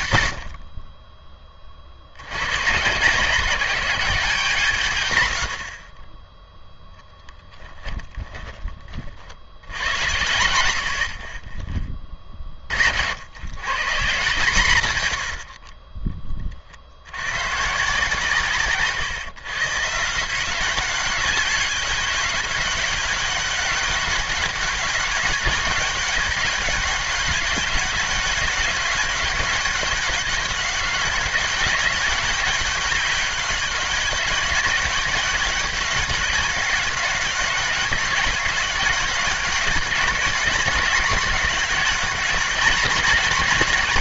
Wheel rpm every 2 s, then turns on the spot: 50, 120, 160, 0, 20, 80, 40, 150, 40, 140, 180, 190, 200, 190, 200, 190, 200, 200, 200, 200, 210, 200.
none